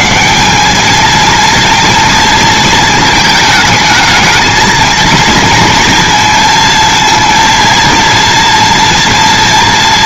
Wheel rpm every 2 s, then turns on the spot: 210, 220, 220, 230, 230.
none